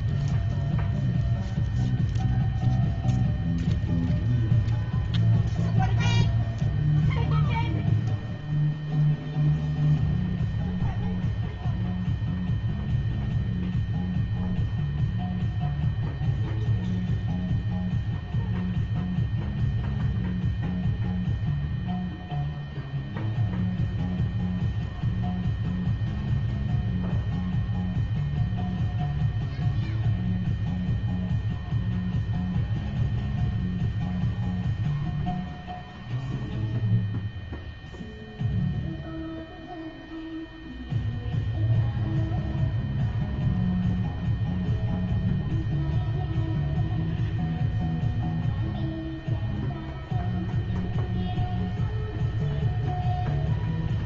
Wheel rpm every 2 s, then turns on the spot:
0, 0, 0, 0, 0, 0, 0, 0, 0, 0, 0, 0, 0, 0, 0, 0, 0, 0, 0, 0, 0, 0, 0, 0, 0, 0, 0.
none